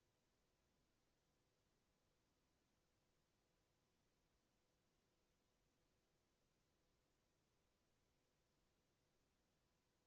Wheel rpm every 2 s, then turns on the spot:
0, 0, 0, 0, 0.
none